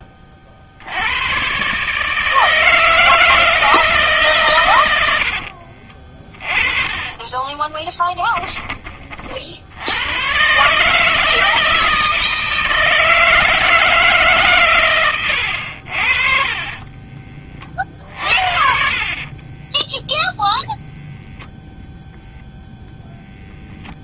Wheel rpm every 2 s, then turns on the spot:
50, 160, 130, 20, 10, 120, 160, 140, 40, 60, 0, 0.
6-8 16-20